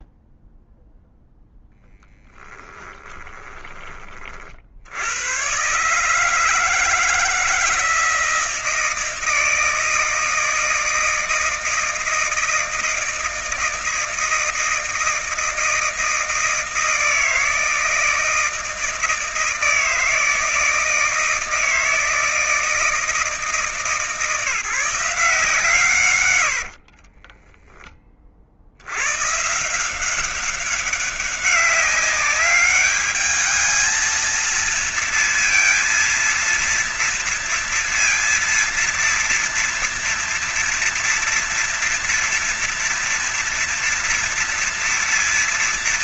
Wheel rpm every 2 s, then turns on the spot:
0, 10, 40, 150, 160, 160, 160, 160, 160, 160, 160, 160, 160, 100, 50, 190, 200, 220, 230, 230, 230, 230, 230.
2-4 26-28